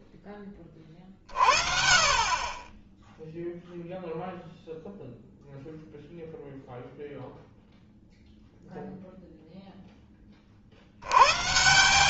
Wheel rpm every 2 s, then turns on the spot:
20, 20, 0, 0, 0, 50.
none